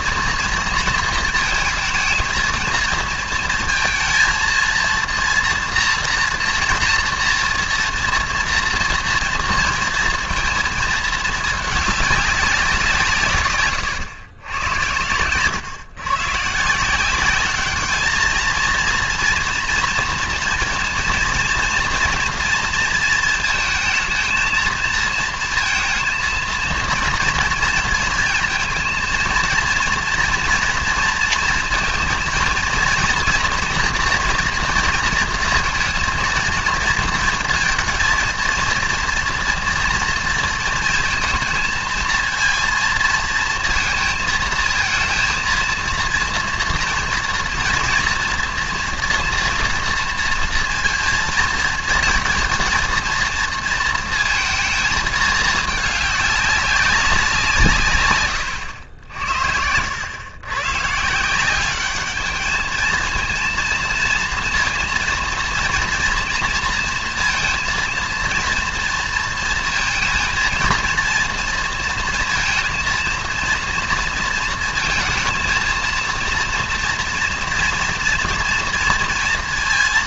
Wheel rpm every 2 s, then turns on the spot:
230, 230, 230, 230, 230, 230, 180, 110, 160, 230, 230, 230, 230, 230, 230, 240, 230, 230, 230, 230, 230, 230, 220, 230, 230, 230, 230, 220, 200, 90, 130, 220, 230, 230, 230, 230, 230, 230, 230, 230.
none